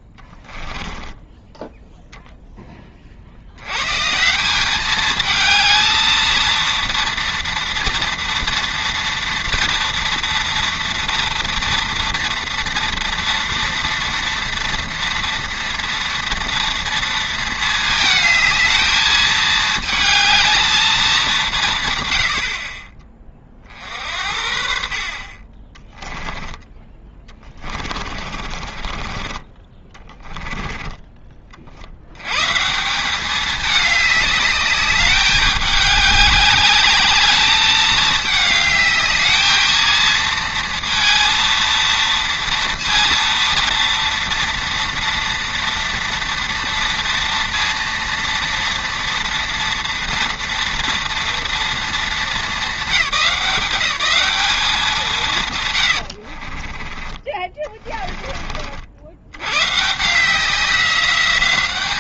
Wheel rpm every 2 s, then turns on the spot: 10, 20, 190, 230, 230, 230, 230, 230, 230, 220, 220, 40, 50, 20, 40, 10, 160, 210, 210, 210, 230, 230, 230, 230, 230, 230, 210, 200, 30, 50, 180.
0-2 28-32 56-58